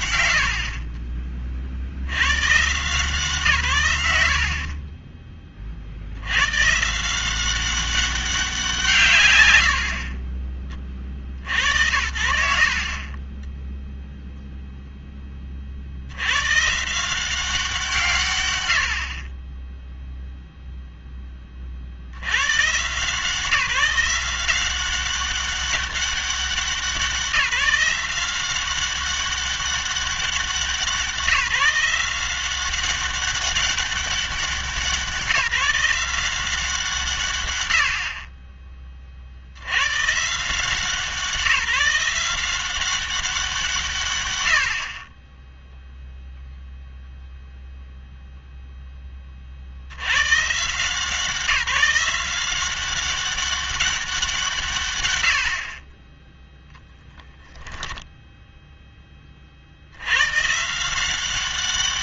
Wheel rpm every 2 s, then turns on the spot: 70, 140, 40, 130, 180, 30, 30, 0, 140, 110, 0, 110, 180, 190, 190, 180, 190, 190, 170, 20, 170, 190, 80, 0, 0, 150, 190, 150, 10, 10, 160.
4-6 12-14 56-58